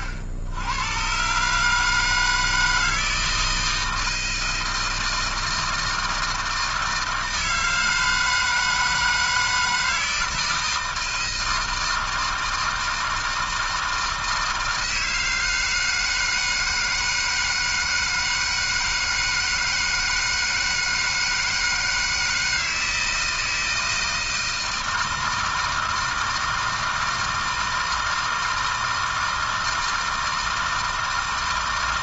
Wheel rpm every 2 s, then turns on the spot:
90, 160, 160, 160, 160, 160, 160, 160, 160, 160, 160, 160, 160, 160, 160, 160.
none